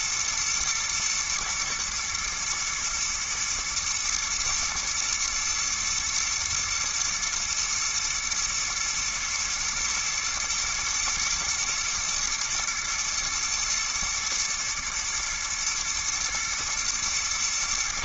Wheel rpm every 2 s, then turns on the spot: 120, 110, 120, 120, 110, 110, 120, 120, 120.
none